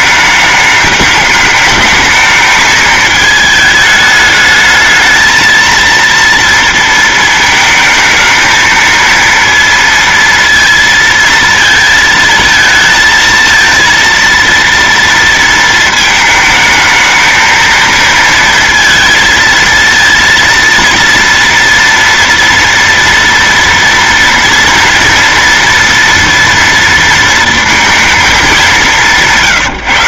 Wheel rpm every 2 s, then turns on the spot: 210, 220, 210, 230, 220, 230, 230, 230, 220, 230, 230, 230, 230, 230, 200.
none